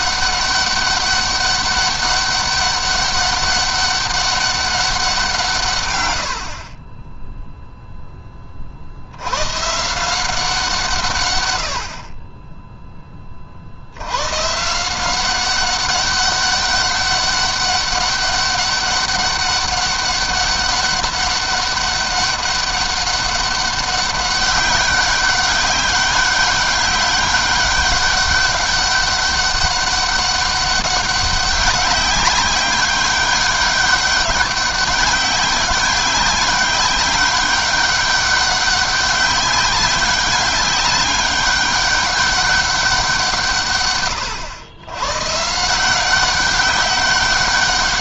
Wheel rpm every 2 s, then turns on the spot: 200, 200, 200, 40, 30, 170, 20, 130, 200, 200, 200, 200, 190, 200, 200, 200, 190, 200, 200, 200, 200, 200, 110, 190.
none